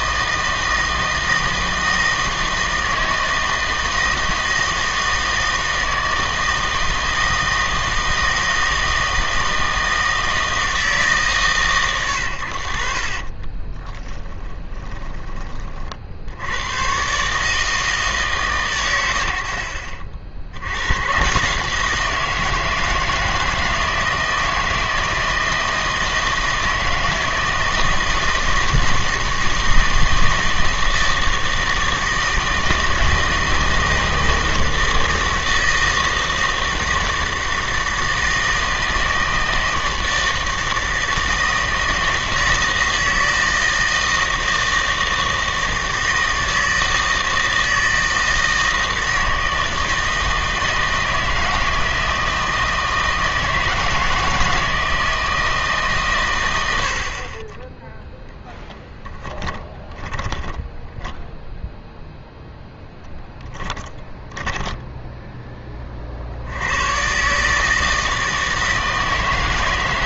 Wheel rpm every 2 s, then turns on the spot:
160, 160, 160, 160, 160, 160, 70, 20, 100, 120, 80, 170, 160, 160, 160, 160, 160, 160, 160, 160, 160, 160, 160, 160, 160, 160, 160, 160, 90, 10, 10, 0, 10, 90, 160.
14-16 58-62 64-66